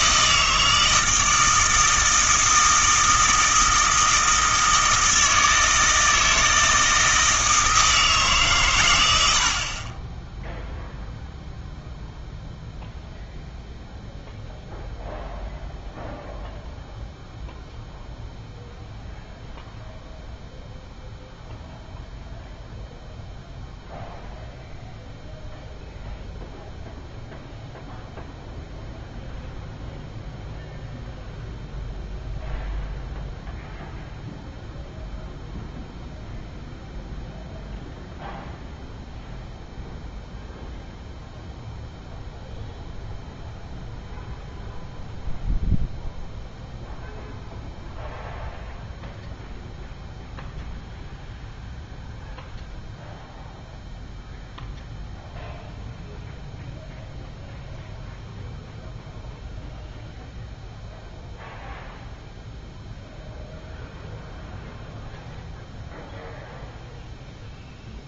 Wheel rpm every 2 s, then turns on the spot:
160, 160, 160, 160, 120, 0, 0, 0, 0, 0, 0, 0, 0, 0, 0, 0, 0, 0, 0, 0, 0, 0, 0, 0, 0, 0, 0, 0, 0, 0, 0, 0, 0, 0.
none